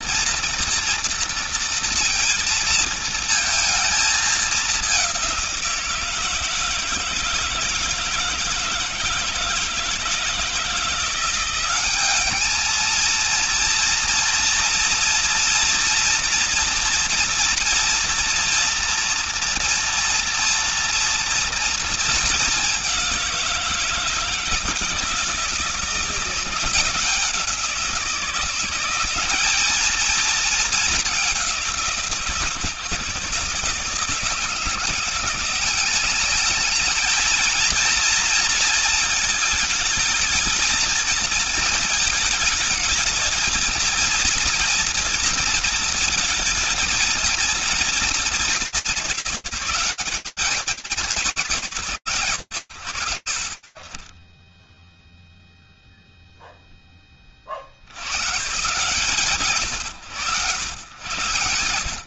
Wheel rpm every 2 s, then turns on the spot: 230, 230, 210, 160, 160, 170, 210, 230, 240, 230, 230, 210, 160, 170, 180, 220, 160, 160, 200, 230, 220, 220, 240, 230, 190, 140, 40, 0, 40, 140, 110.
none